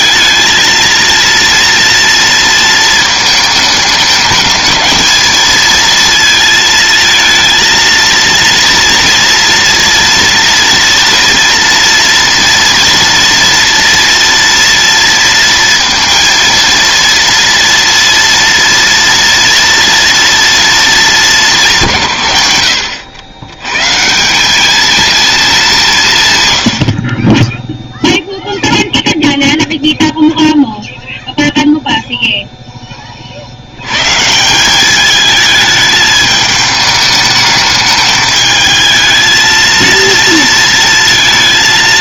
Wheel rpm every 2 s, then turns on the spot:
230, 220, 220, 220, 230, 230, 240, 230, 230, 230, 220, 100, 220, 40, 0, 0, 30, 210, 210, 220, 230.
none